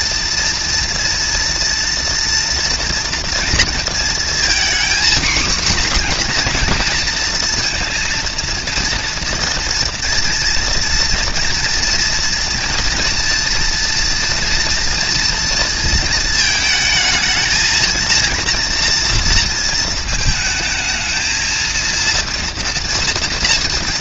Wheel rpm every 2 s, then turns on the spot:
230, 230, 240, 230, 230, 230, 230, 230, 220, 230, 220, 230.
none